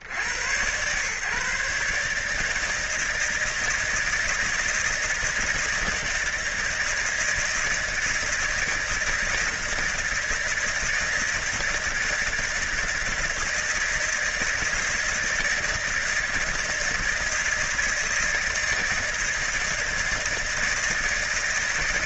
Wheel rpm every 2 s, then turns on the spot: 80, 160, 160, 160, 160, 160, 160, 160, 160, 160, 160.
none